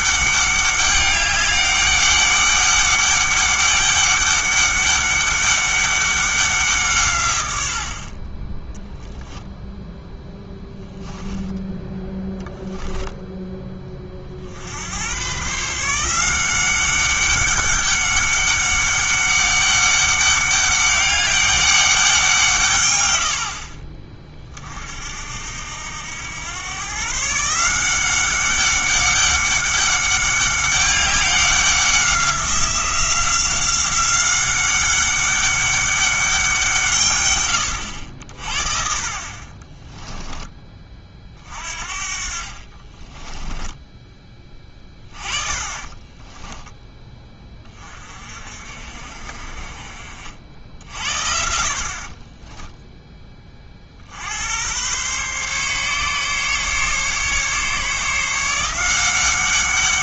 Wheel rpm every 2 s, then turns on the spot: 200, 200, 200, 180, 10, 10, 10, 80, 190, 200, 200, 140, 40, 110, 190, 200, 180, 190, 160, 50, 20, 40, 30, 10, 50, 60, 10, 100, 140, 170.
10-12 42-44 52-54